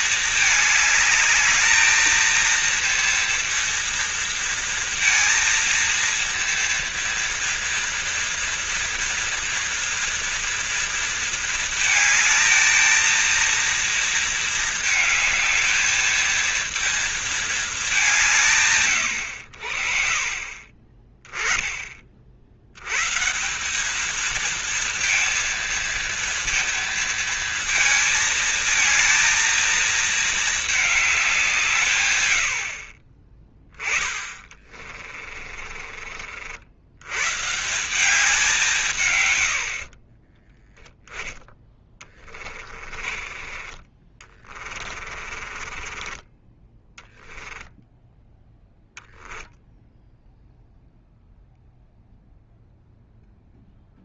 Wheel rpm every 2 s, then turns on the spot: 210, 230, 230, 230, 230, 230, 230, 220, 230, 130, 30, 110, 230, 230, 220, 210, 50, 30, 100, 150, 10, 30, 30, 20, 0, 0, 0.
34-36 42-46